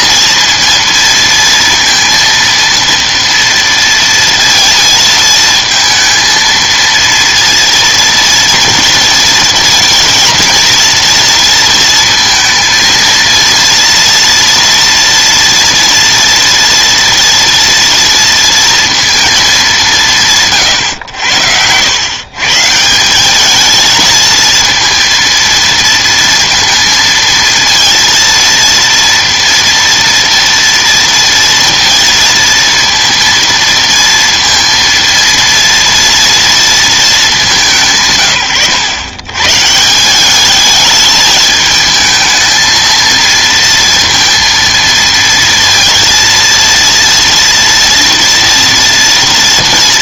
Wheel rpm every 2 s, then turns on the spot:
230, 230, 230, 230, 230, 230, 230, 230, 230, 230, 140, 140, 230, 230, 230, 230, 230, 230, 230, 120, 210, 230, 230, 230, 230.
none